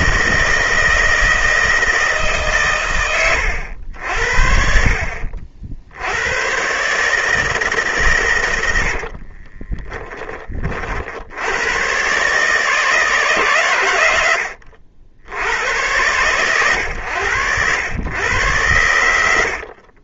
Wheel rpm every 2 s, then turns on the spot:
160, 130, 60, 130, 80, 30, 150, 80, 110, 100.
8-10